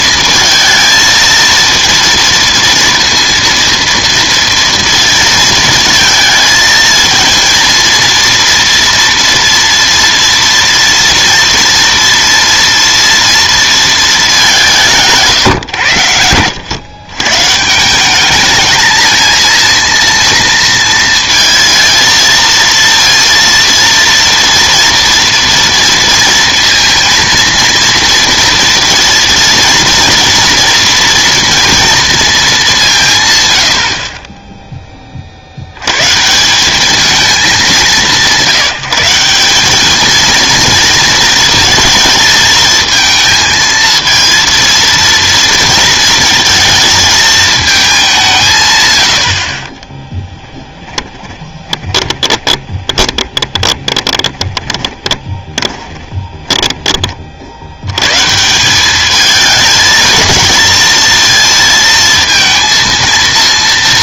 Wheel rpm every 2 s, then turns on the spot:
220, 230, 230, 230, 230, 230, 230, 180, 110, 220, 230, 230, 230, 230, 230, 230, 200, 10, 200, 180, 220, 220, 230, 220, 140, 10, 20, 20, 20, 180, 220, 230.
50-56